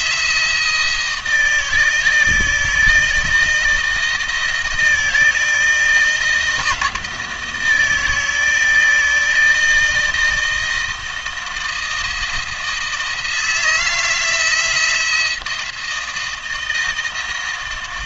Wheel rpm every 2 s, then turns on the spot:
170, 160, 160, 160, 160, 160, 170, 170, 160.
none